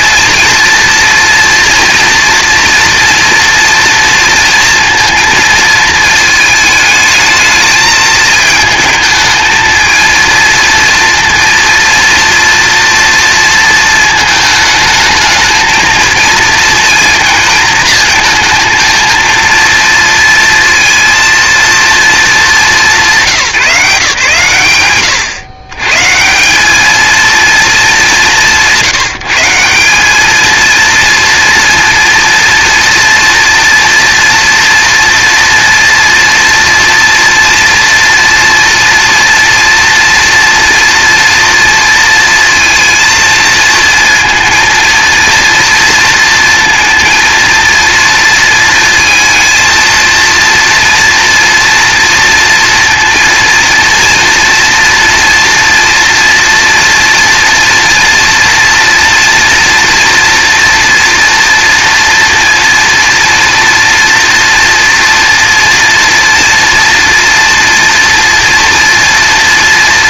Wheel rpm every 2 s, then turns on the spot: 230, 230, 230, 220, 220, 230, 230, 220, 220, 230, 230, 180, 110, 230, 180, 230, 230, 230, 240, 230, 240, 230, 230, 230, 230, 230, 230, 230, 230, 230, 240, 230, 230, 230, 230.
none